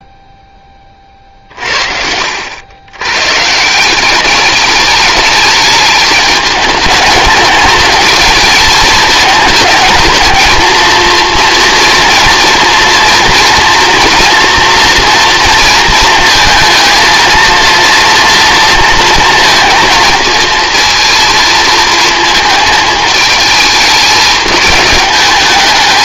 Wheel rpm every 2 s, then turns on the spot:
20, 90, 210, 210, 220, 220, 230, 230, 230, 230, 230, 220, 200.
none